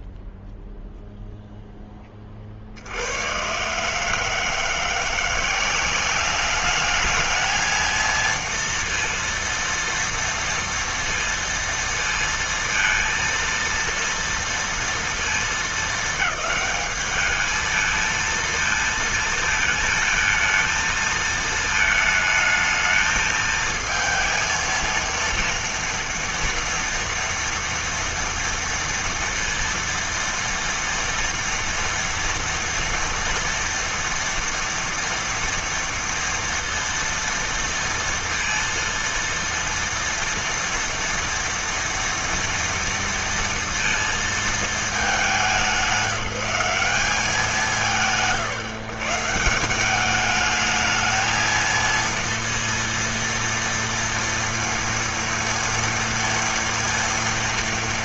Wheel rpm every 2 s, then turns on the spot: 0, 100, 170, 220, 230, 230, 230, 230, 210, 230, 220, 220, 230, 230, 230, 230, 230, 230, 230, 230, 230, 230, 200, 190, 140, 220, 230, 230, 230.
none